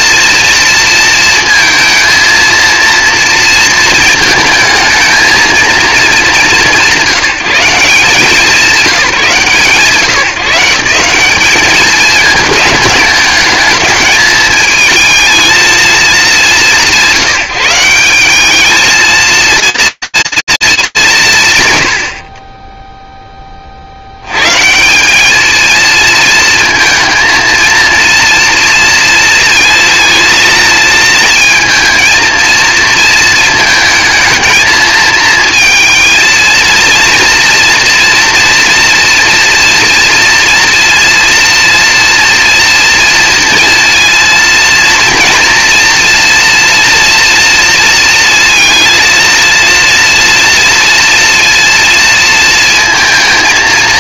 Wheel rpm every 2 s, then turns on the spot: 230, 230, 220, 160, 180, 160, 220, 220, 160, 210, 230, 90, 100, 230, 230, 230, 230, 220, 220, 230, 230, 230, 230, 240, 230, 230, 230.
none